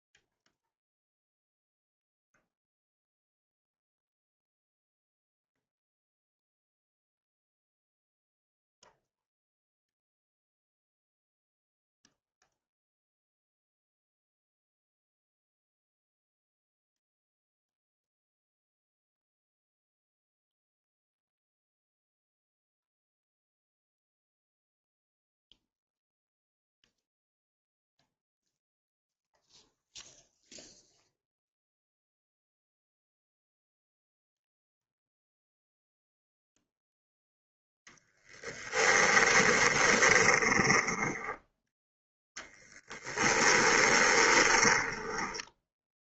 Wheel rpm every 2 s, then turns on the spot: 0, 0, 0, 0, 0, 0, 0, 0, 0, 0, 0, 0, 0, 0, 0, 0, 0, 0, 0, 10, 10, 10, 20.
38-46